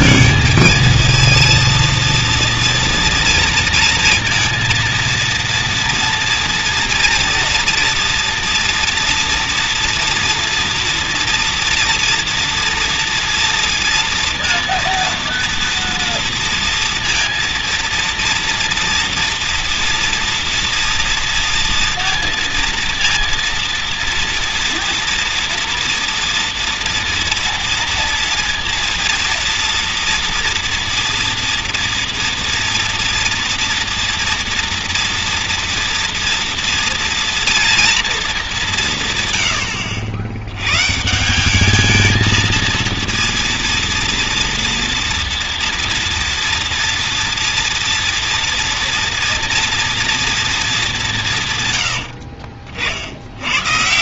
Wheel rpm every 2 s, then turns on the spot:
220, 230, 230, 230, 230, 230, 230, 230, 230, 240, 240, 230, 230, 230, 240, 230, 230, 230, 230, 190, 100, 220, 230, 230, 230, 220, 40.
none